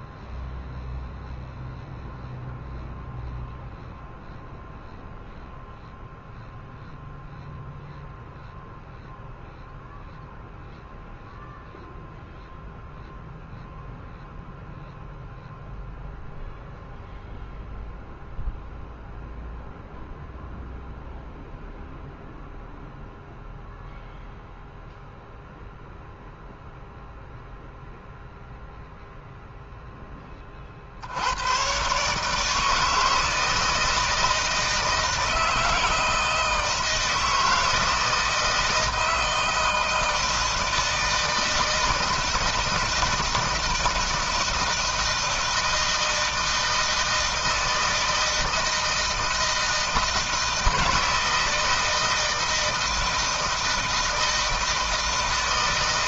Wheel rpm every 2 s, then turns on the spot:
0, 0, 0, 0, 0, 0, 0, 0, 0, 0, 0, 0, 0, 0, 0, 40, 160, 160, 160, 160, 160, 160, 160, 160, 160, 160, 160, 160.
none